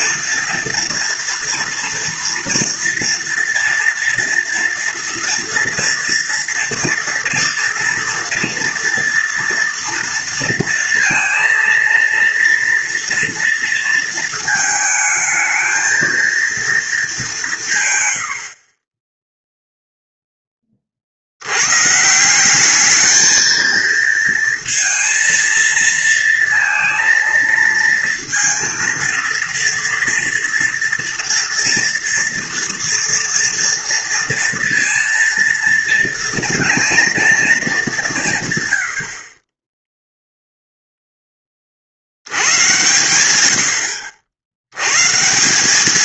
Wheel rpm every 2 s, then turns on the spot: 230, 230, 230, 230, 230, 230, 230, 220, 230, 60, 20, 190, 230, 230, 230, 240, 230, 230, 230, 130, 0, 100, 70.
none